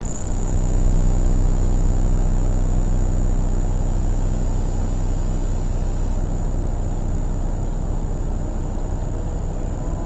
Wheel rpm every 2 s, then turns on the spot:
0, 0, 0, 0, 0.
none